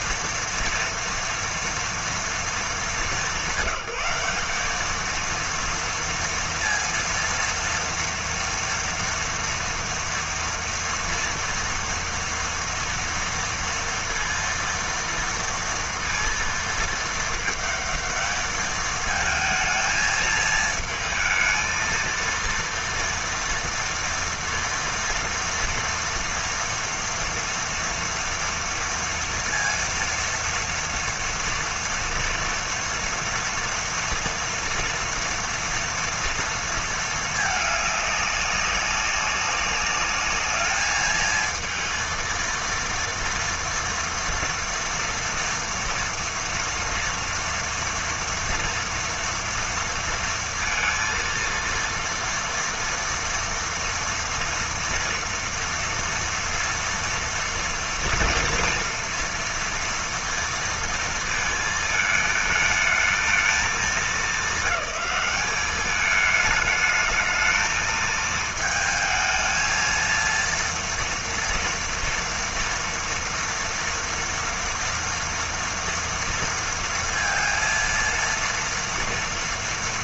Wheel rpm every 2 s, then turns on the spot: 230, 200, 220, 230, 230, 230, 230, 230, 220, 220, 220, 230, 230, 240, 230, 230, 230, 230, 220, 190, 210, 230, 230, 240, 230, 230, 230, 230, 230, 230, 230, 220, 210, 210, 220, 230, 230, 230, 230, 230.
none